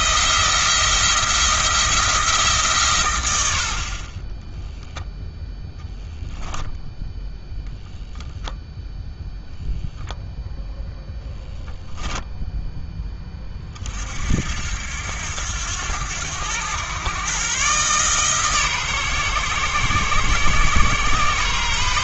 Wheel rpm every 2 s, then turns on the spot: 170, 130, 0, 0, 10, 10, 10, 80, 110, 140, 130.
none